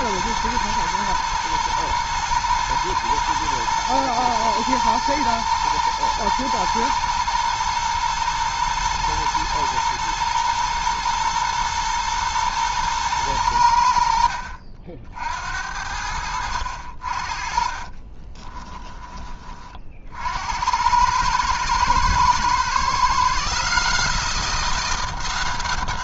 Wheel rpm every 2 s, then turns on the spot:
110, 120, 110, 110, 110, 120, 120, 60, 70, 20, 80, 120, 170.
16-20